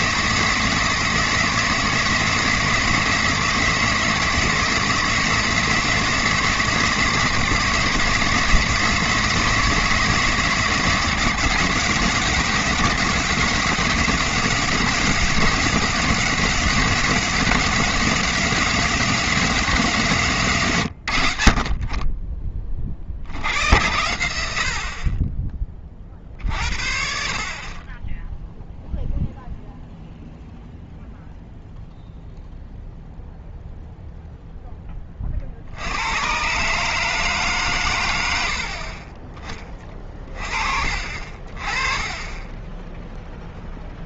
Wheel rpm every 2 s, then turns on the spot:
170, 170, 160, 170, 160, 160, 180, 180, 180, 180, 130, 30, 60, 50, 0, 0, 0, 10, 140, 60, 40, 10.
none